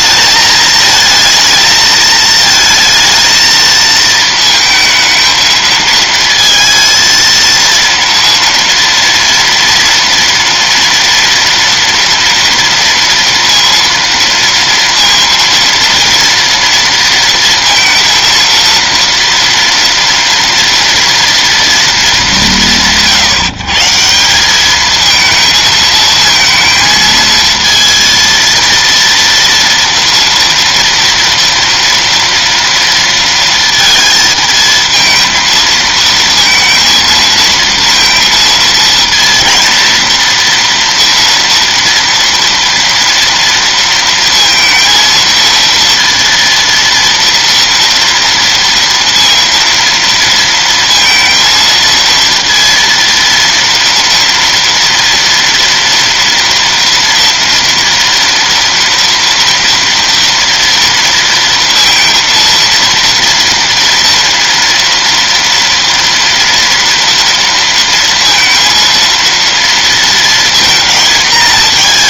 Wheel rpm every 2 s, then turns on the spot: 220, 220, 220, 230, 230, 230, 230, 230, 230, 230, 230, 190, 200, 220, 230, 230, 230, 220, 230, 230, 230, 230, 230, 230, 230, 230, 230, 230, 230, 230, 230, 230, 230, 230, 230, 230.
none